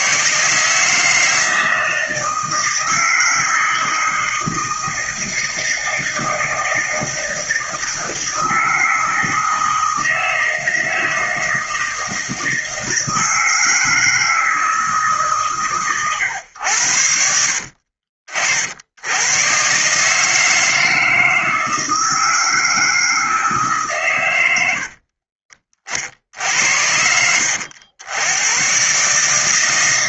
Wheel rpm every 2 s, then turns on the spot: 160, 160, 160, 160, 160, 160, 160, 150, 70, 110, 160, 160, 50, 70, 150.
24-26